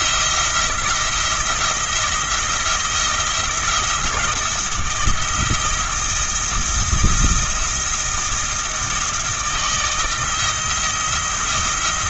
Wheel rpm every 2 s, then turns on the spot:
170, 170, 170, 160, 160, 160.
none